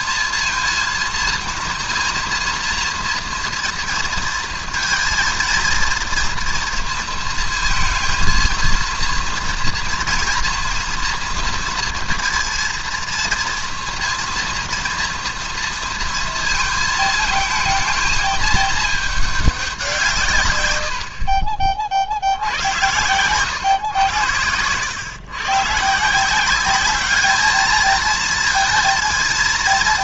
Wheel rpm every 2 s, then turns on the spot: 230, 230, 230, 230, 230, 240, 230, 230, 220, 220, 110, 80, 100, 200, 230.
none